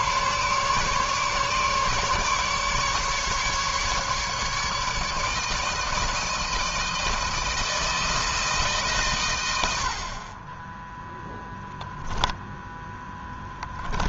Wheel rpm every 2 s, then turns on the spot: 140, 150, 150, 160, 160, 20, 0.
none